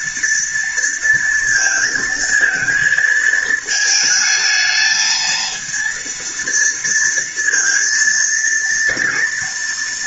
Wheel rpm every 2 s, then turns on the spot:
230, 220, 220, 230, 230.
none